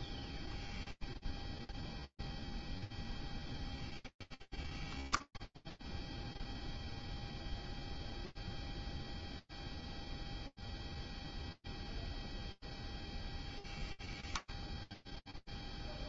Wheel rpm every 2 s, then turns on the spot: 0, 0, 0, 0, 0, 0, 20, 10.
none